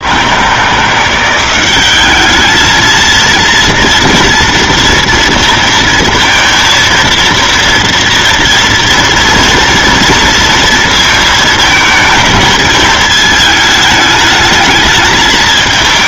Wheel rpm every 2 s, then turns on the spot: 170, 220, 230, 230, 230, 230, 220, 220.
none